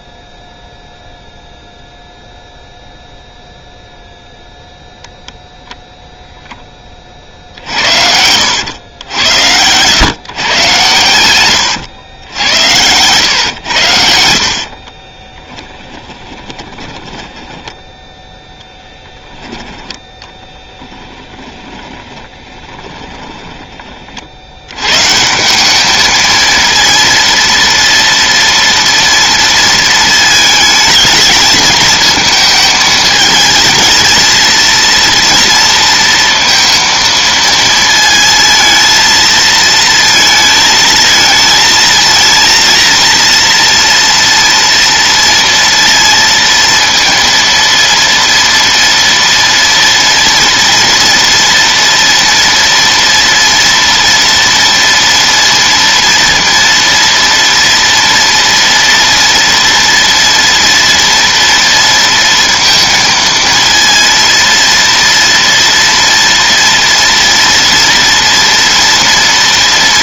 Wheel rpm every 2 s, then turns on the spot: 0, 0, 0, 20, 90, 110, 100, 40, 10, 0, 10, 20, 120, 230, 230, 220, 220, 230, 230, 220, 220, 230, 230, 230, 230, 230, 240, 230, 230, 230, 230, 230, 230, 230, 230.
14-18 20-24